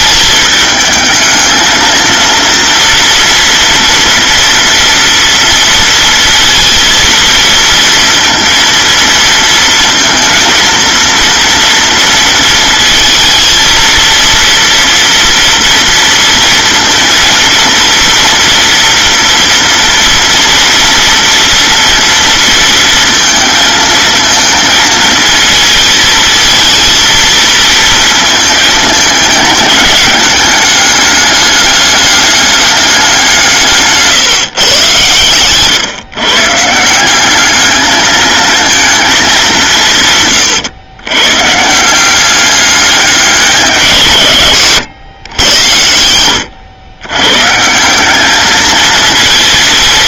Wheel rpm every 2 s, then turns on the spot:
220, 240, 230, 230, 230, 230, 230, 230, 230, 230, 230, 230, 220, 220, 210, 210, 190, 120, 190, 210, 130, 190, 100, 110, 230.
none